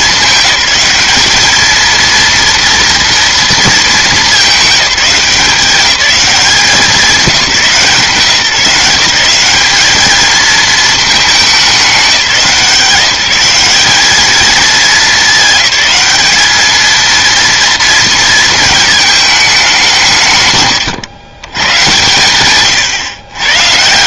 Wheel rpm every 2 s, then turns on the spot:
210, 230, 200, 190, 170, 220, 170, 220, 220, 220, 130, 120.
none